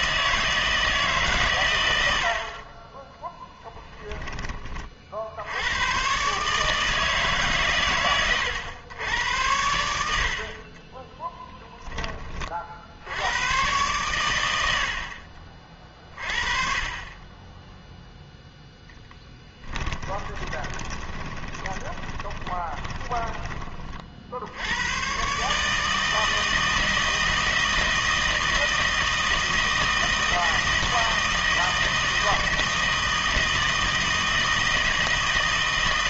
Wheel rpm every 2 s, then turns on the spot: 160, 40, 30, 150, 110, 40, 50, 70, 30, 0, 20, 10, 80, 160, 160, 160, 160, 160.
20-24